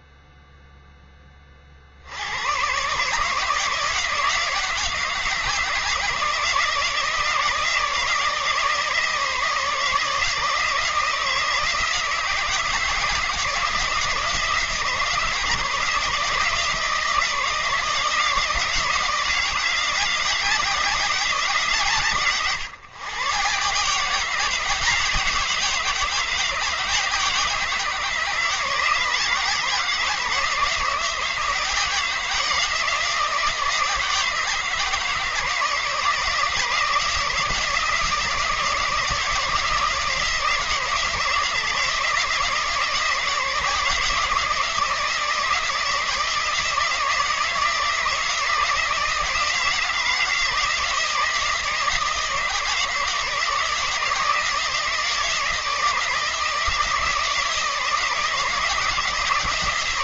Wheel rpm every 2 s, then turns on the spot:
0, 120, 170, 160, 160, 160, 160, 160, 160, 160, 180, 140, 170, 170, 160, 160, 170, 160, 160, 160, 160, 160, 160, 160, 170, 160, 160, 160, 160, 160.
none